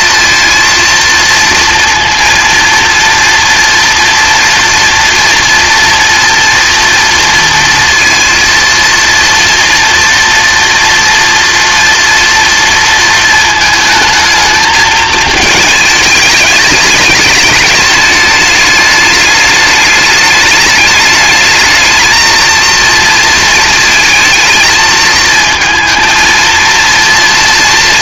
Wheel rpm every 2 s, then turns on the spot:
230, 230, 230, 230, 230, 230, 230, 220, 210, 210, 210, 230, 230, 230.
none